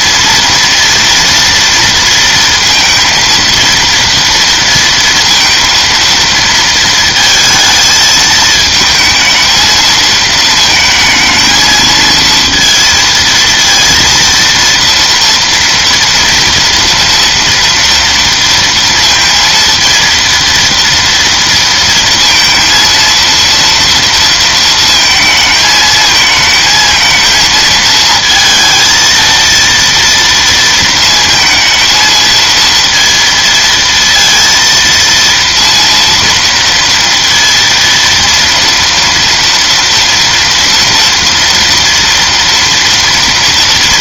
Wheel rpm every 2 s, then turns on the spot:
230, 230, 230, 230, 220, 220, 230, 230, 230, 230, 230, 230, 230, 220, 230, 230, 230, 230, 230, 230, 230, 230.
none